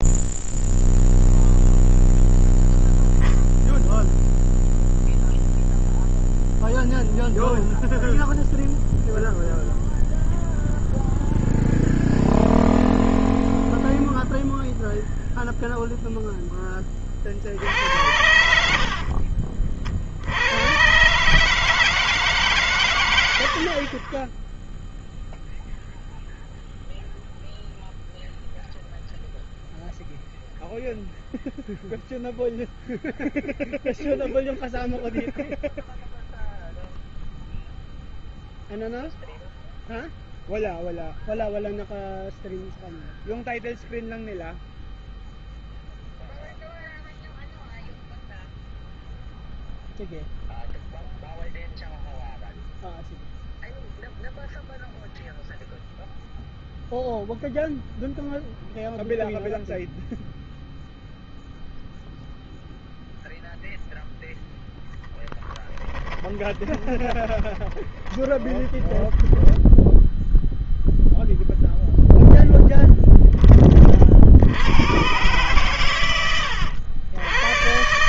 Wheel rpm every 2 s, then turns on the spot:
0, 0, 0, 0, 0, 0, 0, 0, 20, 60, 110, 120, 0, 0, 0, 0, 0, 0, 0, 0, 0, 0, 0, 0, 0, 0, 0, 0, 0, 0, 0, 0, 0, 30, 30, 0, 0, 90, 90.
18-20 66-70